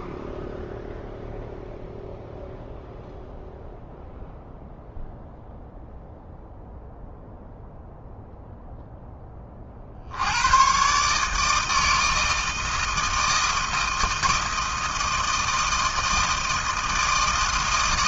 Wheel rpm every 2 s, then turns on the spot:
0, 0, 0, 0, 0, 110, 160, 160, 160.
none